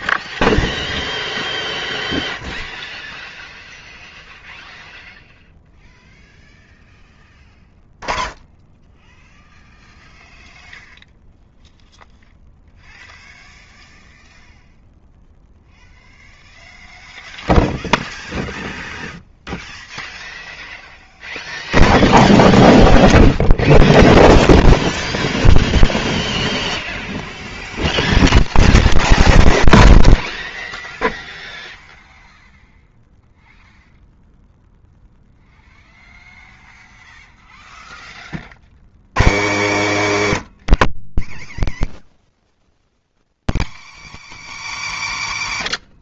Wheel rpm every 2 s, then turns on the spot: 0, 0, 0, 0, 20, 0, 0, 0, 0, 0, 0, 0, 0, 0, 0, 0, 0, 0, 0, 60, 250, 90, 280.
none